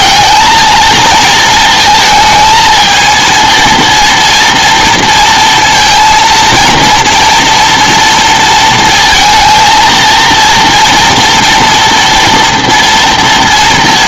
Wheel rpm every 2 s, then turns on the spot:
220, 220, 230, 230, 230, 230, 230.
none